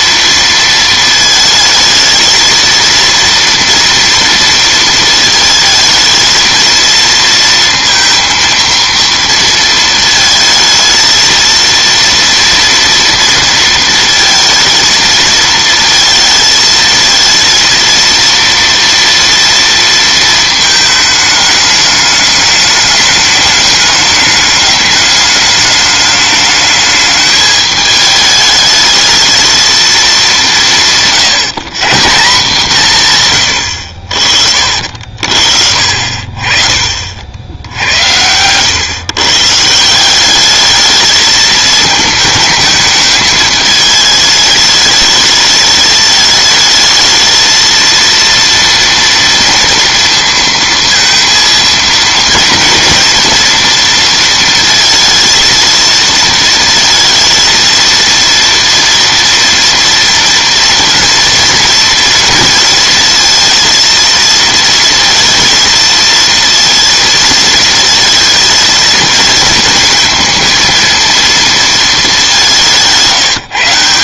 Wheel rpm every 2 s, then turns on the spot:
230, 230, 230, 230, 230, 220, 230, 220, 220, 230, 220, 210, 210, 210, 210, 160, 170, 50, 40, 110, 210, 220, 210, 220, 230, 230, 230, 230, 230, 230, 230, 230, 230, 230, 220, 230, 180.
none